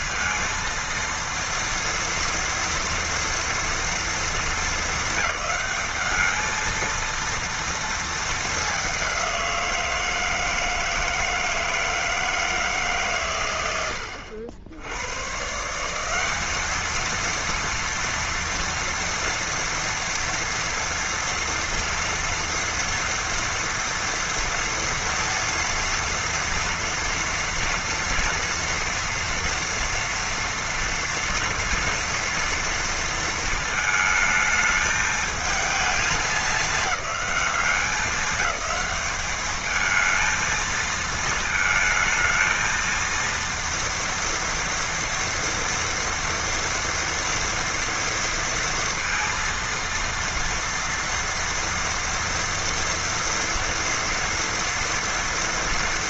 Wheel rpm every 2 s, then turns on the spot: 230, 230, 220, 220, 210, 160, 160, 80, 200, 230, 240, 230, 230, 230, 230, 240, 230, 220, 210, 200, 220, 220, 230, 230, 230, 230, 230, 230.
none